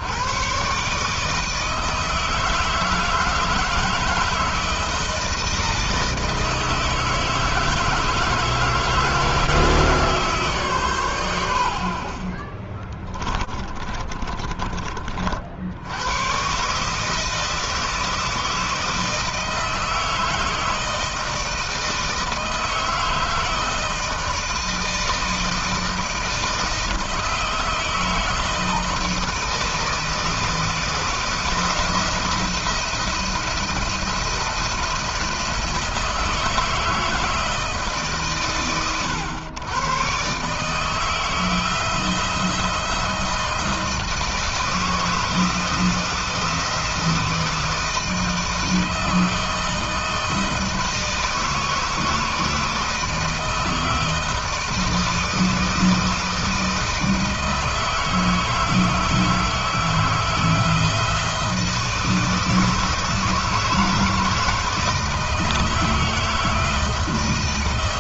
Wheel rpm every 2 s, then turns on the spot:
150, 160, 160, 160, 160, 130, 30, 40, 150, 160, 160, 160, 160, 160, 160, 160, 170, 170, 160, 120, 160, 160, 160, 160, 160, 160, 160, 160, 160, 160, 160, 160, 160, 160.
12-14